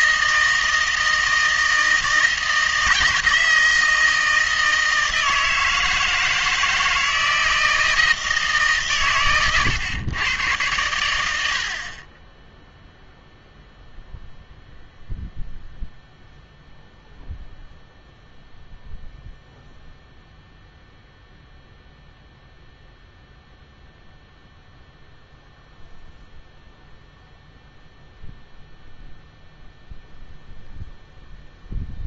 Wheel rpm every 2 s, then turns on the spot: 160, 160, 160, 160, 150, 110, 0, 0, 0, 0, 0, 0, 0, 0, 0, 0.
none